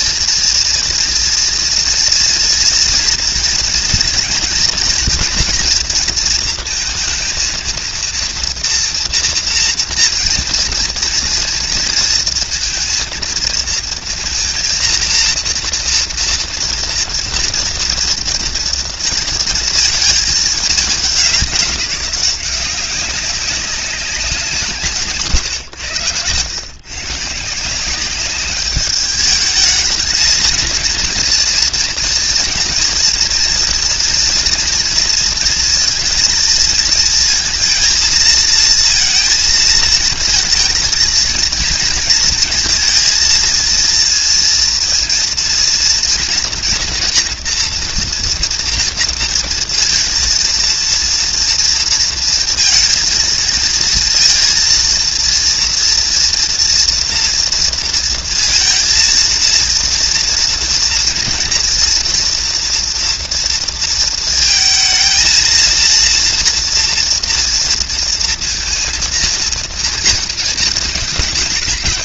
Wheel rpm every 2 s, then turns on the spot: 230, 230, 230, 230, 230, 230, 230, 230, 230, 240, 210, 180, 180, 120, 200, 220, 230, 230, 230, 230, 230, 230, 230, 240, 240, 230, 230, 230, 230, 230, 230, 240, 230, 240, 230, 220.
none